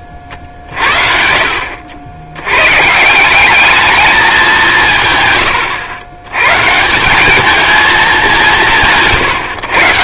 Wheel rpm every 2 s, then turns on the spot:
30, 130, 150, 140, 100.
none